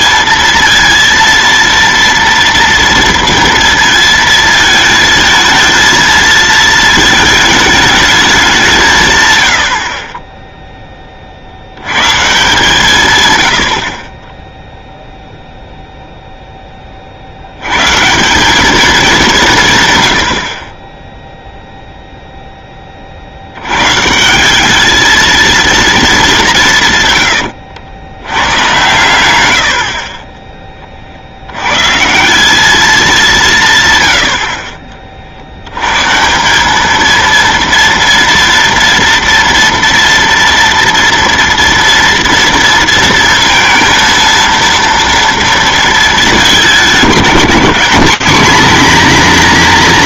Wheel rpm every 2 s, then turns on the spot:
230, 230, 220, 220, 160, 10, 140, 0, 10, 200, 20, 20, 200, 150, 120, 30, 200, 50, 190, 240, 240, 230, 230, 190, 240.
none